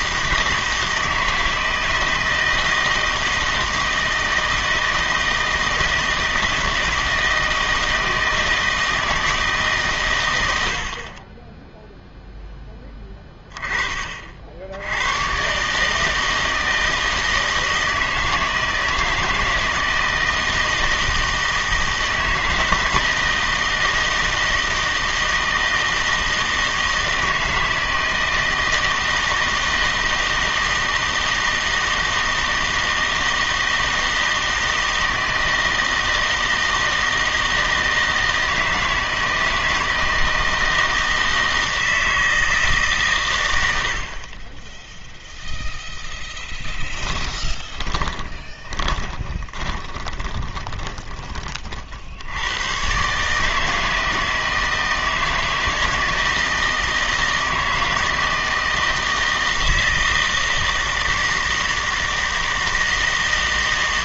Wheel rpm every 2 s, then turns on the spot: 160, 160, 160, 160, 160, 90, 10, 60, 160, 160, 160, 160, 160, 160, 160, 160, 160, 160, 160, 160, 160, 150, 10, 10, 20, 20, 110, 160, 160, 160, 160, 160.
46-52